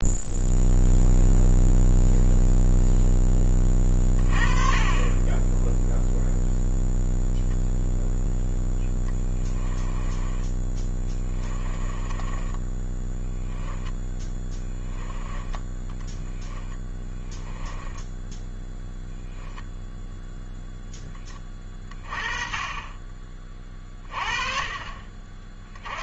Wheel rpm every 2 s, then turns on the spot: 0, 0, 30, 0, 10, 10, 10, 10, 20, 0, 0, 20, 30.
8-18